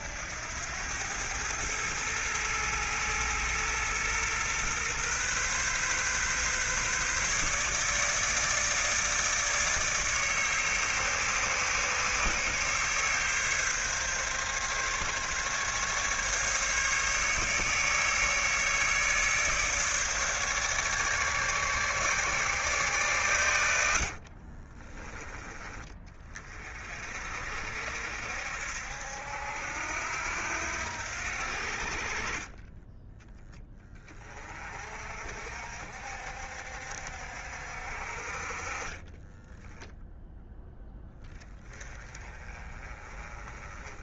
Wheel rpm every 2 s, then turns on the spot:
100, 110, 120, 140, 150, 140, 140, 140, 150, 150, 150, 130, 30, 40, 70, 80, 20, 40, 60, 40, 10, 30.
24-26 32-34 38-40